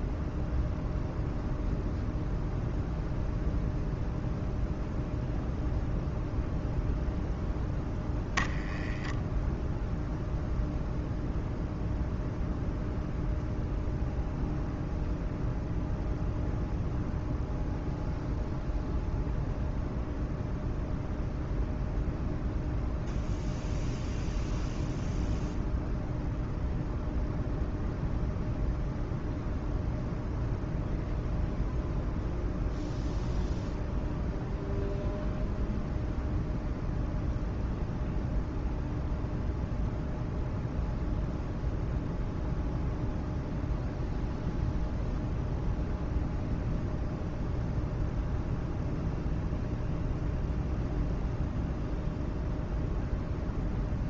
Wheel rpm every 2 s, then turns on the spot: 0, 0, 0, 0, 0, 0, 0, 0, 0, 0, 0, 0, 0, 0, 0, 0, 0, 0, 0, 0, 0, 0, 0, 0, 0, 0, 0.
none